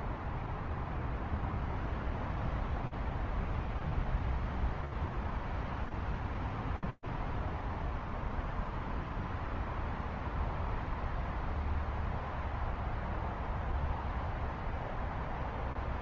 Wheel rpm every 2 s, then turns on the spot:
0, 0, 0, 0, 0, 0, 0, 0.
none